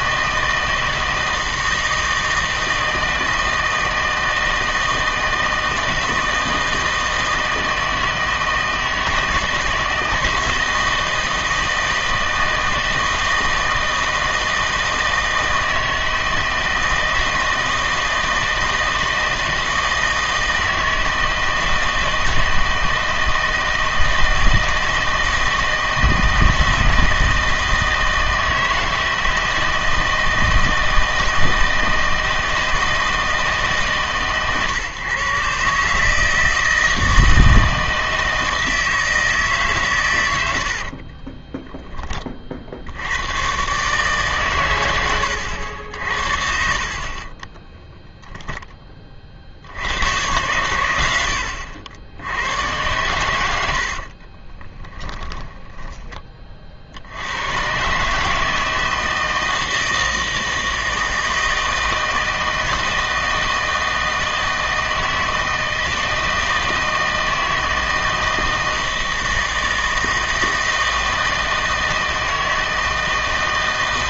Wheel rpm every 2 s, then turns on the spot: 160, 160, 160, 160, 160, 160, 160, 160, 160, 160, 160, 160, 160, 160, 160, 160, 160, 130, 160, 160, 80, 50, 110, 50, 10, 110, 100, 20, 40, 160, 160, 160, 160, 160, 160, 160, 160.
40-42 46-48 54-56